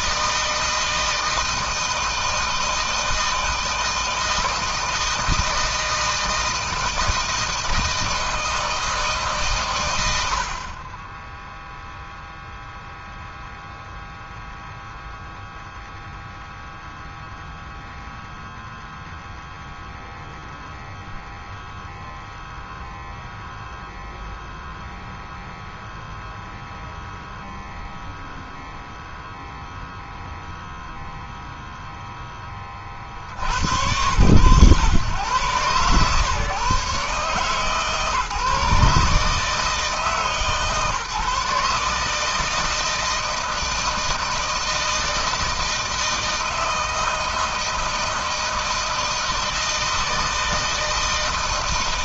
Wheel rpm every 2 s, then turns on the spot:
160, 160, 160, 160, 150, 10, 0, 0, 0, 0, 0, 0, 0, 0, 0, 0, 70, 120, 140, 150, 150, 160, 160, 160, 160, 160.
none